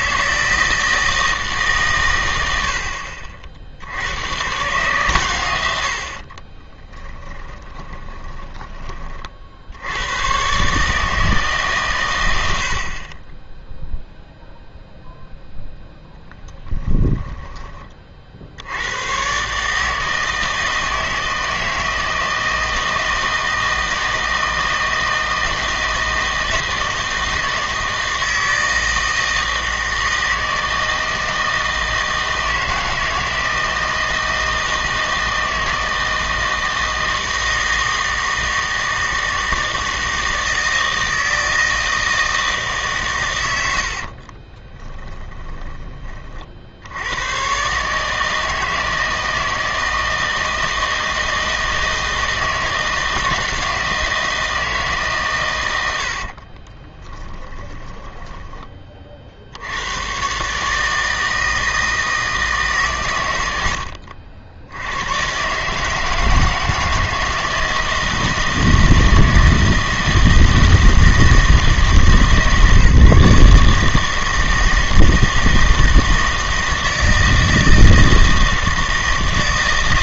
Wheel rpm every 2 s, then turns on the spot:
160, 90, 130, 30, 20, 130, 80, 0, 20, 80, 160, 160, 160, 160, 160, 160, 160, 160, 160, 160, 160, 160, 30, 60, 160, 160, 160, 160, 30, 20, 150, 150, 90, 160, 160, 160, 150, 160, 160, 160.
6-10 16-18 44-46 56-58